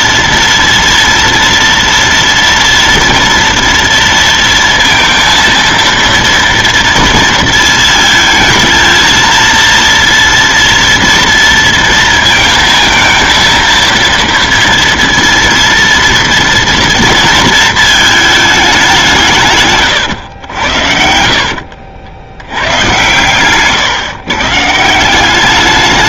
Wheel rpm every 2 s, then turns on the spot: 230, 230, 230, 230, 220, 230, 230, 230, 230, 210, 80, 100, 140.
none